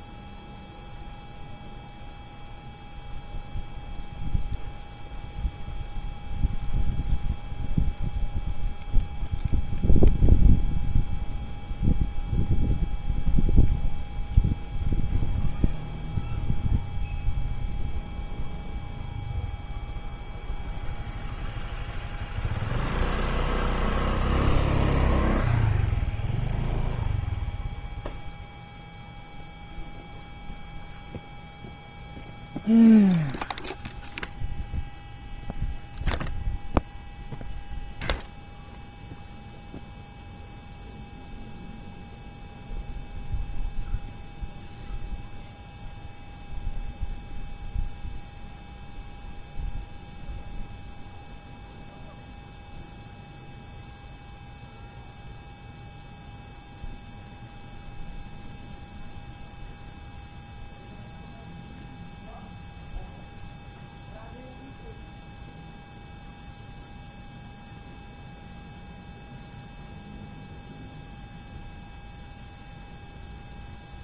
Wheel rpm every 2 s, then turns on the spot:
0, 0, 0, 0, 0, 0, 0, 0, 0, 0, 0, 0, 0, 0, 0, 0, 0, 0, 0, 0, 0, 0, 0, 0, 0, 0, 0, 0, 0, 0, 0, 0, 0, 0, 0, 0, 0.
none